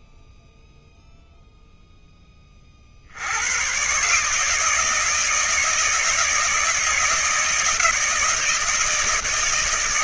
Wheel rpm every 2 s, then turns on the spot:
0, 90, 160, 160, 150.
none